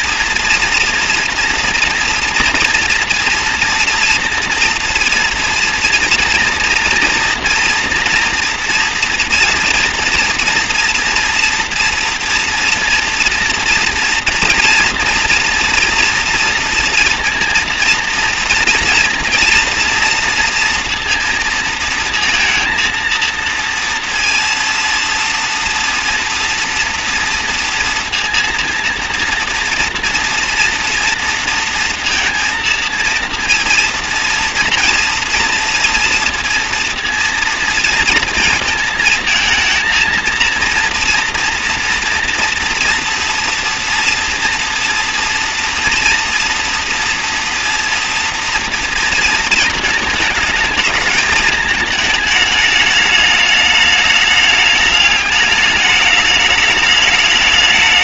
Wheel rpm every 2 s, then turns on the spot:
230, 230, 230, 230, 230, 240, 240, 230, 230, 230, 230, 230, 230, 240, 230, 230, 230, 240, 230, 220, 230, 230, 240, 230, 230, 210, 210, 210, 210.
none